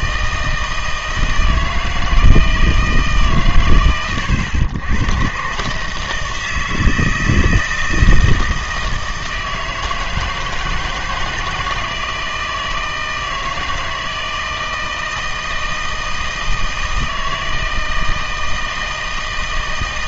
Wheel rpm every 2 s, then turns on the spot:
160, 160, 100, 160, 160, 160, 160, 160, 160, 160.
none